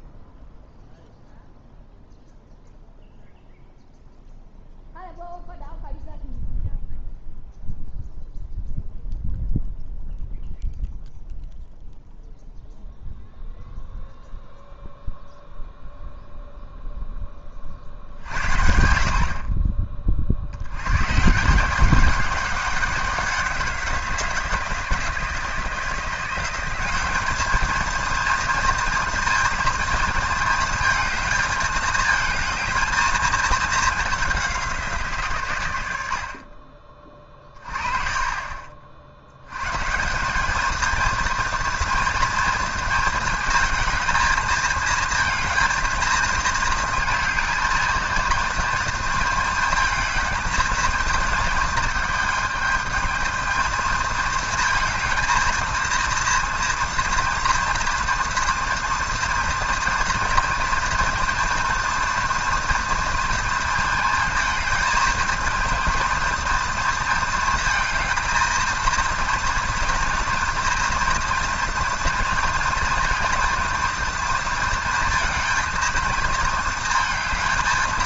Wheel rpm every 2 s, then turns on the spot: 0, 0, 0, 0, 0, 0, 0, 0, 0, 60, 110, 190, 170, 190, 230, 220, 220, 180, 30, 40, 220, 230, 220, 230, 230, 220, 220, 220, 230, 230, 230, 230, 220, 230, 230, 230, 230, 230, 220.
none